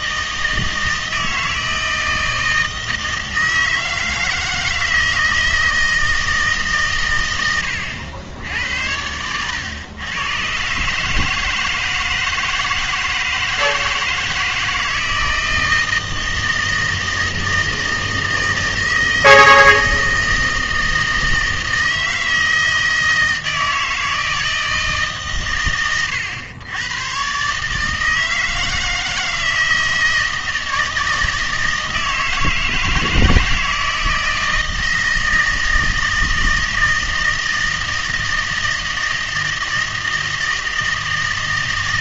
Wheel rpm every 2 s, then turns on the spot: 160, 160, 160, 150, 90, 130, 160, 160, 160, 160, 160, 160, 160, 110, 160, 160, 160, 160, 160, 160, 160.
none